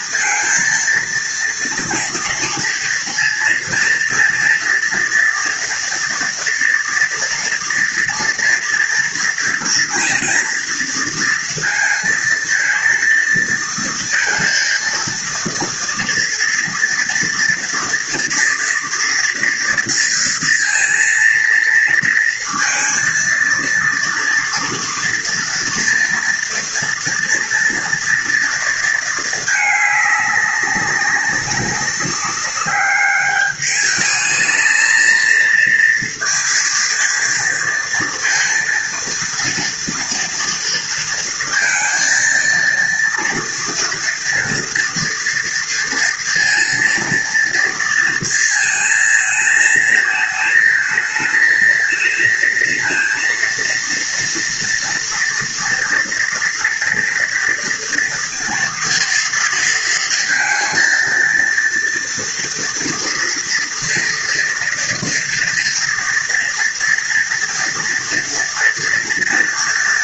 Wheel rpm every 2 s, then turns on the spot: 230, 230, 240, 230, 230, 230, 230, 230, 230, 230, 230, 230, 230, 230, 220, 200, 200, 230, 230, 230, 230, 230, 230, 230, 220, 220, 230, 230, 240, 230, 230, 230, 230, 240, 240.
none